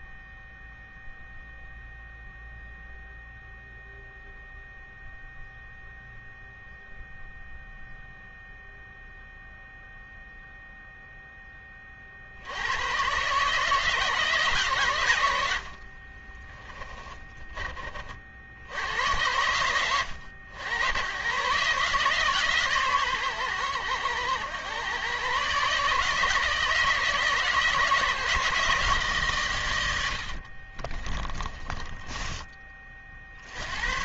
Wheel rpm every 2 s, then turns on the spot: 0, 0, 0, 0, 0, 0, 100, 130, 20, 50, 100, 130, 120, 160, 160, 40, 30.
16-18 30-32